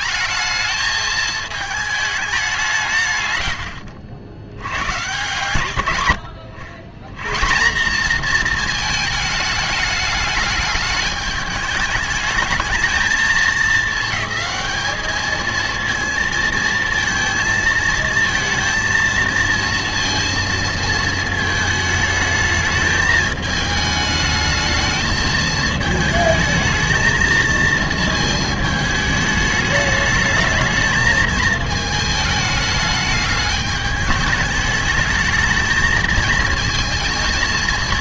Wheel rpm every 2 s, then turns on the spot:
210, 180, 110, 110, 230, 210, 220, 220, 230, 230, 230, 220, 220, 220, 220, 220, 210, 210, 230.
none